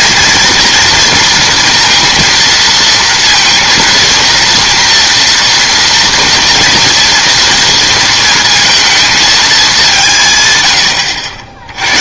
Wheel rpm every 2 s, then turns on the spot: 230, 230, 230, 230, 230, 130.
none